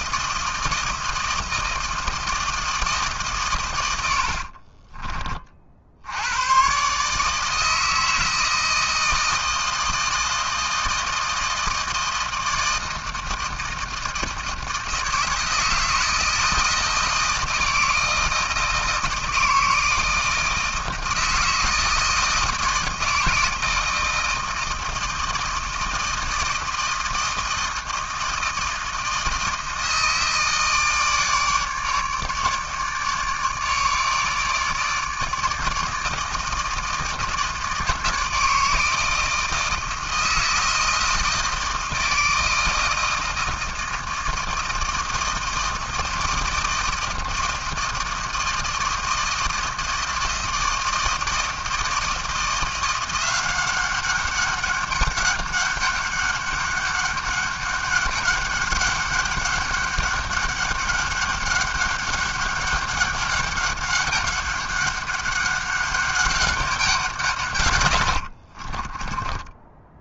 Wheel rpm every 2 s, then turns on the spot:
160, 140, 30, 150, 160, 160, 160, 160, 160, 160, 160, 160, 160, 160, 160, 150, 150, 150, 160, 160, 160, 160, 160, 160, 160, 160, 180, 200, 200, 200, 200, 200, 200, 160, 30.
none